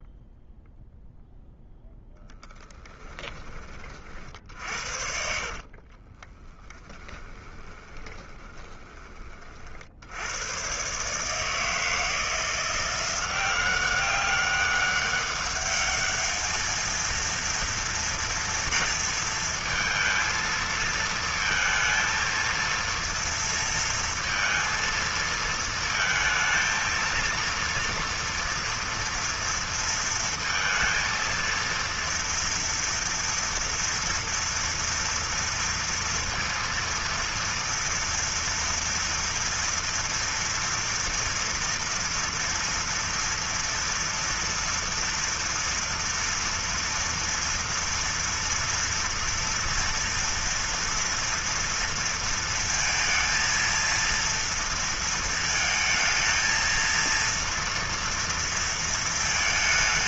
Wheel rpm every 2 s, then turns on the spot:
0, 20, 50, 20, 20, 110, 170, 200, 220, 230, 230, 230, 230, 230, 230, 230, 230, 230, 230, 230, 230, 230, 240, 230, 230, 230, 230, 230, 230, 230.
2-10